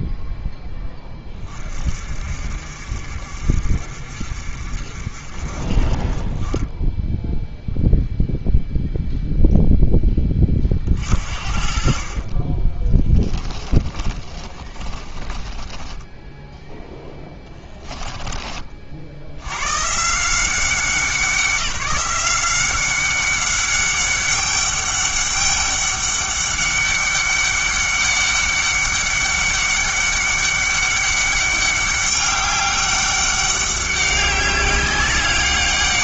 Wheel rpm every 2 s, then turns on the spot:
10, 50, 50, 10, 0, 40, 30, 20, 10, 40, 180, 190, 200, 200, 200, 200, 200, 200.
14-18